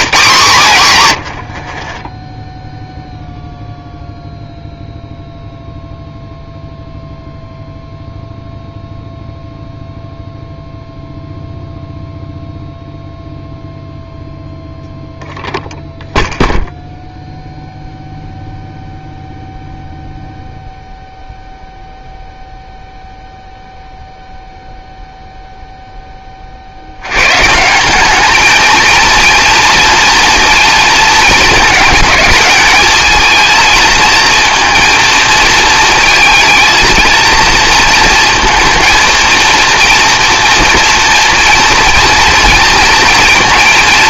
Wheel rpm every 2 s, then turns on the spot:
140, 0, 0, 0, 0, 0, 0, 0, 0, 0, 0, 0, 0, 60, 220, 230, 210, 230, 230, 230, 230, 230.
none